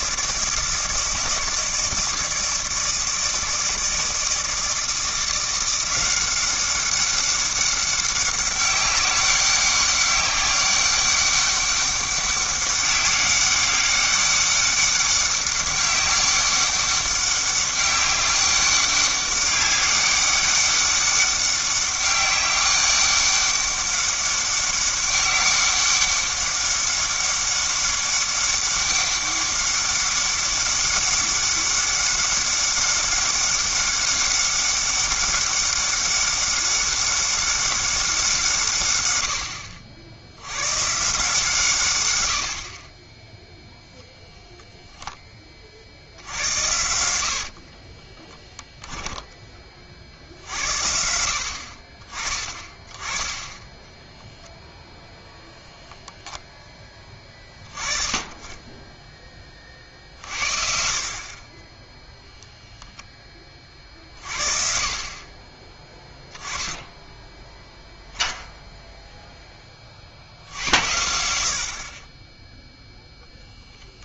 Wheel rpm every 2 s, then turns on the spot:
160, 160, 160, 190, 200, 200, 200, 200, 200, 200, 200, 200, 200, 200, 200, 200, 200, 200, 200, 160, 90, 70, 0, 90, 0, 60, 20, 0, 10, 20, 50, 0, 50, 10, 0, 80, 10.
none